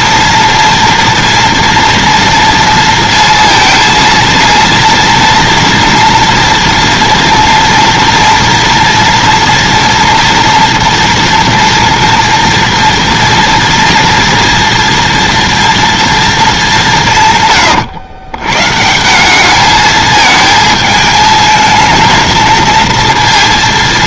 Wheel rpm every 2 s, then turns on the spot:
230, 230, 230, 230, 230, 230, 230, 230, 210, 130, 220, 230.
none